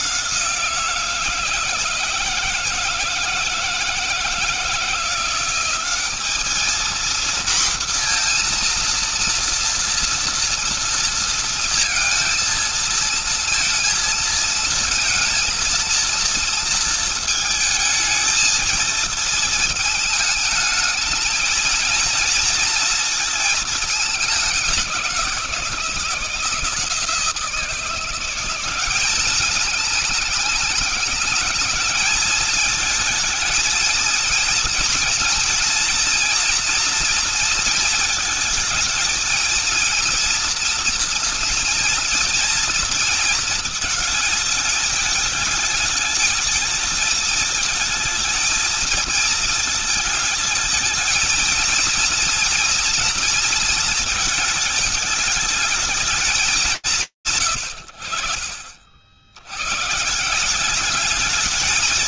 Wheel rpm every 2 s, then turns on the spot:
170, 160, 170, 230, 240, 230, 230, 230, 230, 220, 220, 230, 190, 160, 180, 200, 220, 230, 230, 220, 230, 230, 220, 220, 220, 220, 230, 220, 170, 70, 180.
none